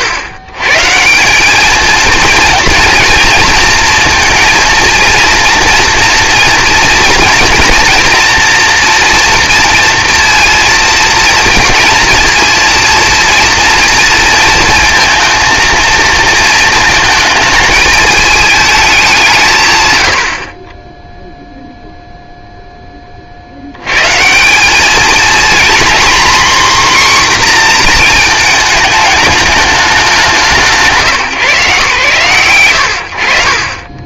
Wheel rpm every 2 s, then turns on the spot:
110, 230, 230, 240, 240, 230, 230, 230, 220, 210, 20, 10, 200, 260, 220, 140, 60.
none